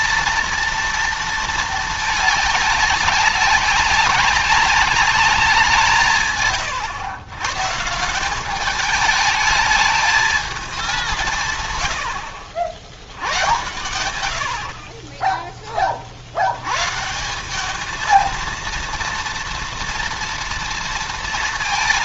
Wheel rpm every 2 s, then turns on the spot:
230, 210, 200, 130, 190, 210, 70, 70, 90, 230, 230.
none